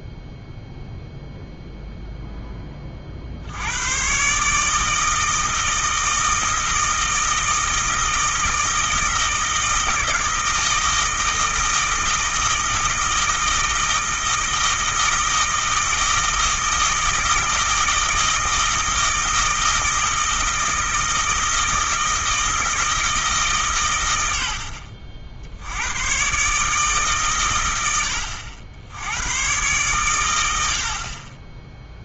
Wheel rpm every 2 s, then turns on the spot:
0, 30, 160, 160, 160, 160, 160, 160, 160, 160, 160, 160, 60, 140, 80, 70.
none